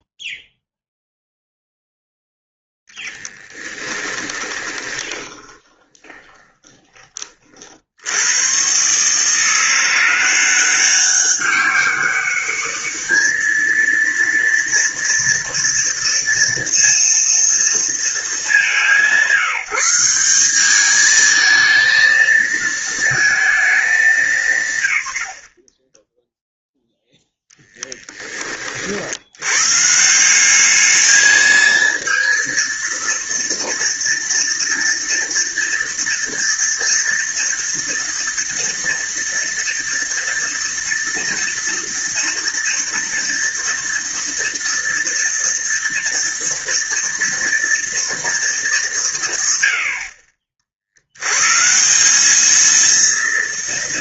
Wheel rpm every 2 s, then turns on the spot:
0, 10, 20, 20, 130, 190, 210, 230, 230, 180, 210, 220, 110, 0, 50, 210, 230, 230, 230, 230, 230, 230, 230, 230, 190, 80, 230.
2-6